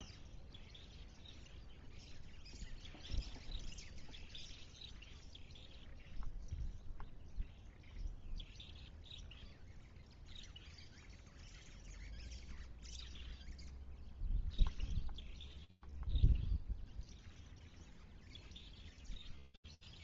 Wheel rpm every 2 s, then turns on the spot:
0, 0, 0, 0, 0, 0, 0, 0, 0, 0.
none